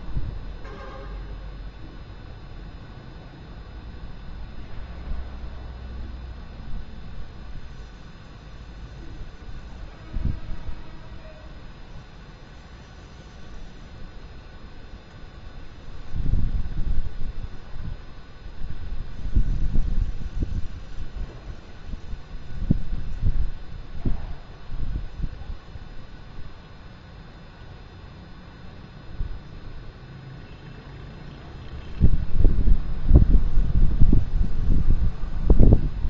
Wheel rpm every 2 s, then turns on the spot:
0, 0, 0, 0, 0, 0, 0, 0, 0, 0, 0, 0, 0, 0, 0, 0, 0, 0.
none